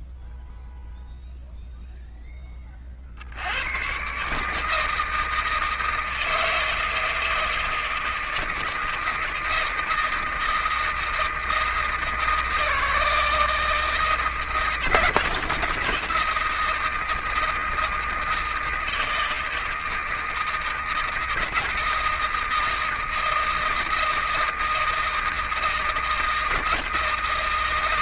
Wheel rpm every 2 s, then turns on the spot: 0, 0, 120, 160, 160, 160, 160, 160, 160, 160, 160, 160, 160, 160.
none